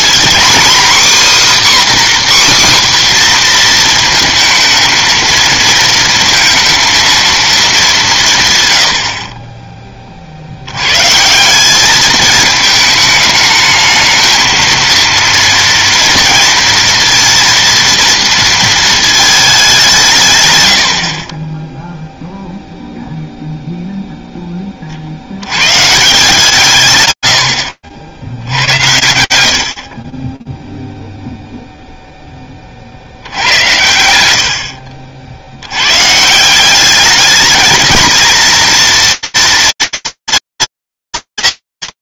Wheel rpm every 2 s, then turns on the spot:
270, 260, 220, 230, 70, 110, 210, 230, 230, 230, 80, 0, 20, 150, 90, 10, 30, 70, 190, 230, 230.
20-22